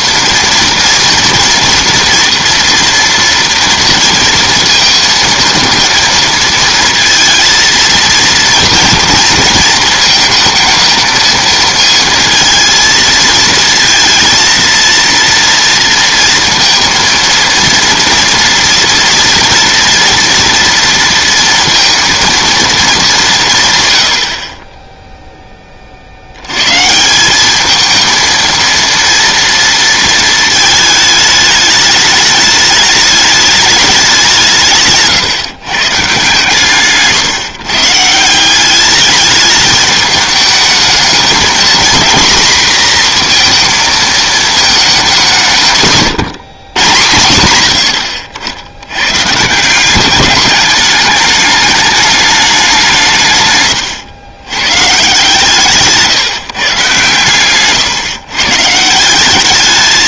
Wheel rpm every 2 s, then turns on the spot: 230, 240, 230, 230, 230, 220, 230, 230, 230, 230, 230, 220, 30, 110, 230, 220, 210, 160, 160, 190, 210, 240, 220, 140, 80, 210, 200, 120, 150, 150.
none